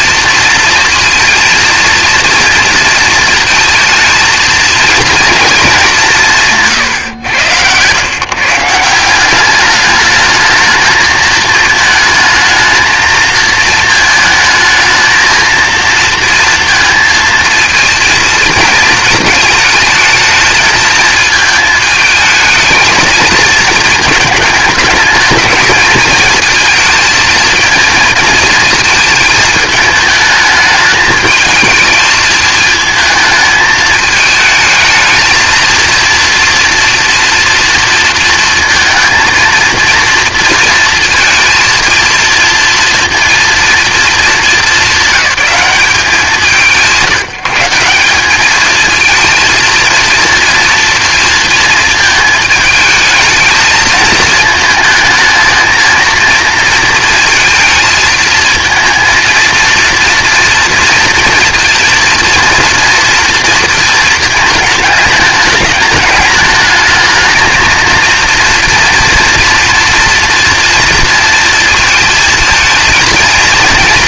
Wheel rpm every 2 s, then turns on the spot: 230, 230, 230, 150, 150, 220, 220, 220, 230, 230, 220, 220, 220, 230, 220, 210, 220, 220, 230, 220, 230, 230, 220, 180, 220, 230, 220, 220, 230, 230, 230, 230, 220, 210, 230, 230, 230.
none